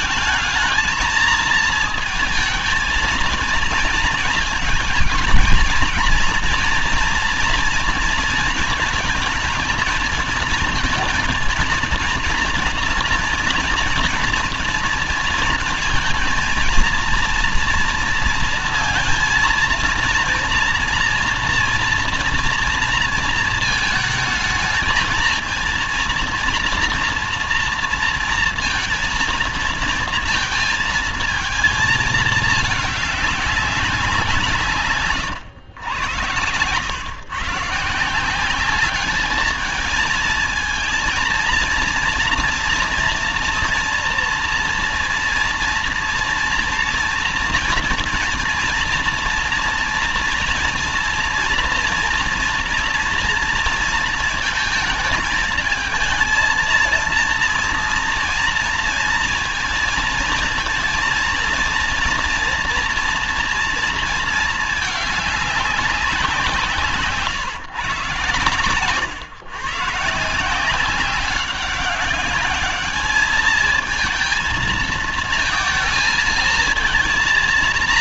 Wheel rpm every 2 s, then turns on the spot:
220, 220, 220, 230, 230, 220, 230, 230, 230, 230, 230, 230, 220, 230, 230, 230, 220, 160, 100, 180, 220, 240, 230, 230, 230, 230, 230, 220, 230, 230, 230, 230, 220, 170, 120, 170, 200, 220, 230.
68-70